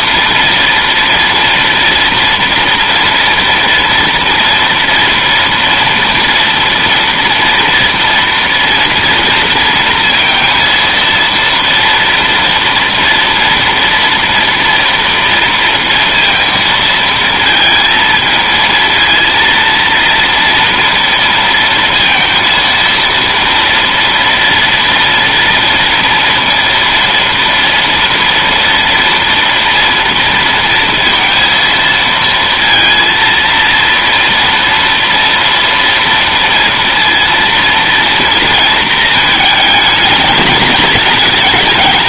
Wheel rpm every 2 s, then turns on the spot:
230, 230, 230, 230, 230, 230, 230, 230, 230, 220, 230, 230, 230, 230, 230, 230, 230, 230, 230, 230, 210.
none